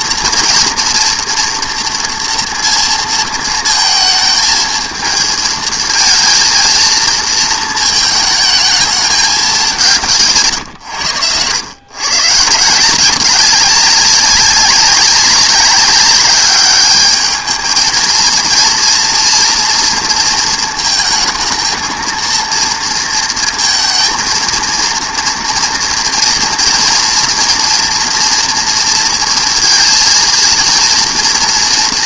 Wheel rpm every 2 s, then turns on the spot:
230, 230, 220, 220, 220, 130, 160, 200, 200, 230, 220, 230, 230, 230, 230, 230.
10-12